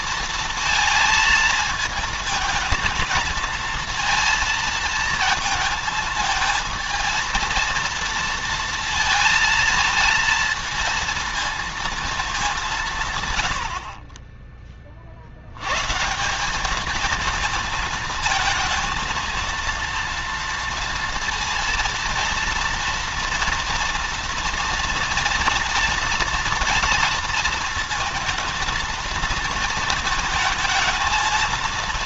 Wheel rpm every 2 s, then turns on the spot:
220, 220, 230, 220, 230, 230, 170, 40, 210, 230, 230, 230, 230, 230, 230, 220.
none